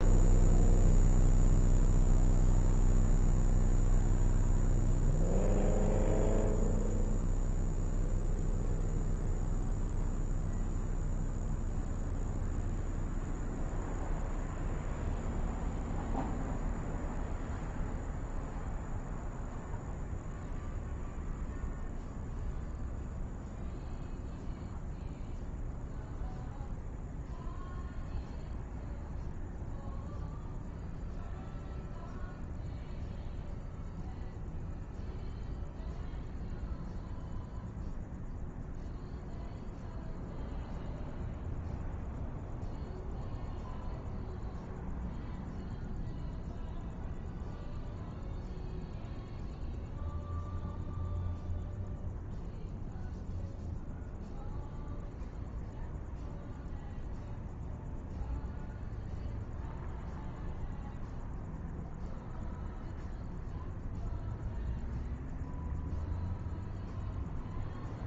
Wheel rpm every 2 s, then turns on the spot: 0, 0, 0, 0, 0, 0, 0, 0, 0, 0, 0, 0, 0, 0, 0, 0, 0, 0, 0, 0, 0, 0, 0, 0, 0, 0, 0, 0, 0, 0, 0, 0, 0, 0.
none